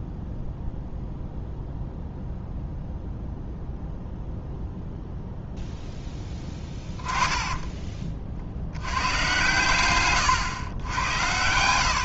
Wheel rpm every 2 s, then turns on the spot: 0, 0, 0, 10, 80, 100.
none